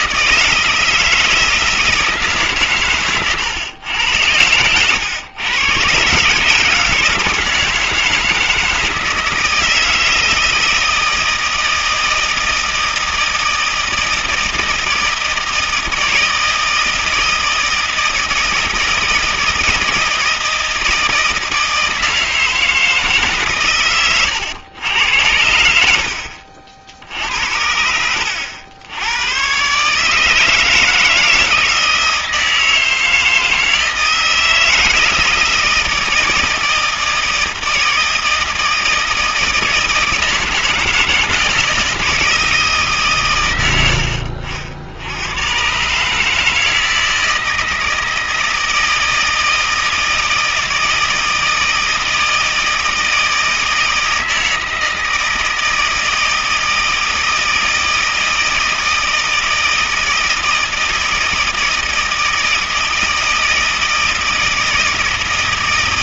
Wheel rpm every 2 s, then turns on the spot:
160, 130, 100, 150, 160, 160, 160, 160, 160, 160, 160, 160, 100, 60, 90, 160, 160, 160, 160, 160, 160, 160, 70, 160, 160, 160, 160, 160, 160, 160, 160, 160, 160.
none